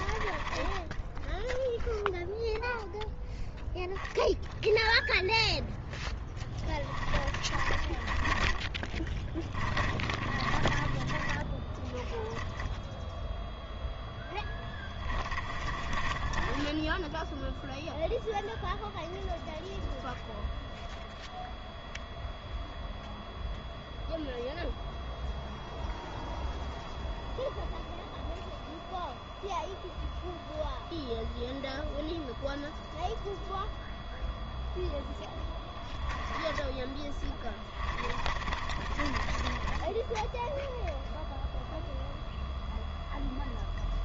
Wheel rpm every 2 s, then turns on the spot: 10, 0, 0, 10, 20, 30, 10, 10, 10, 0, 0, 0, 0, 0, 0, 0, 0, 0, 10, 20, 0, 0.
0-2 6-12 14-18 38-40